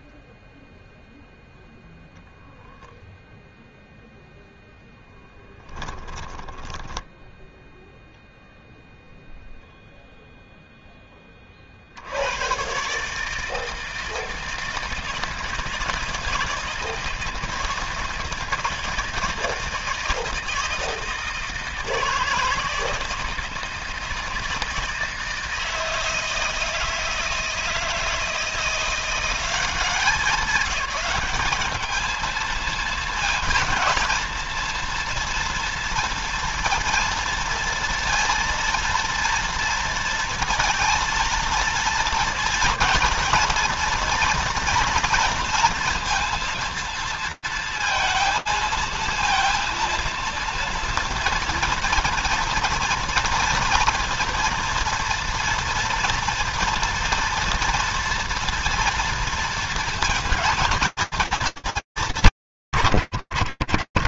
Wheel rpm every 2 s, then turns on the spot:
0, 0, 0, 10, 0, 0, 90, 160, 160, 170, 160, 160, 160, 160, 170, 200, 220, 230, 230, 230, 230, 220, 230, 230, 230, 230, 230, 240, 230, 230, 230, 80.
6-8